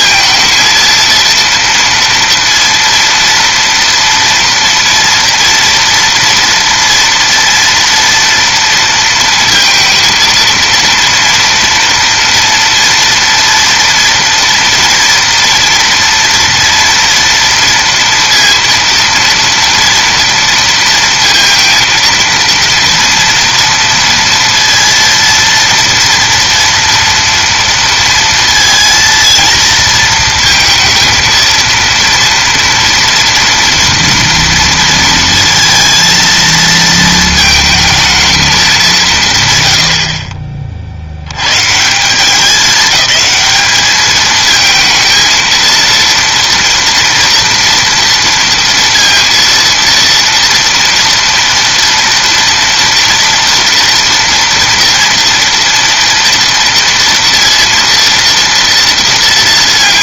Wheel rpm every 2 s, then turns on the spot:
230, 230, 230, 230, 230, 230, 230, 230, 230, 230, 230, 230, 230, 230, 230, 220, 230, 230, 220, 210, 50, 190, 220, 240, 230, 230, 230, 230, 240, 230.
none